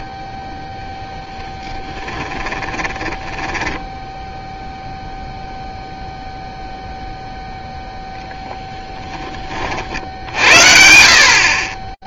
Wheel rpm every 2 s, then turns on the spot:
0, 10, 0, 0, 10, 30.
2-4 8-10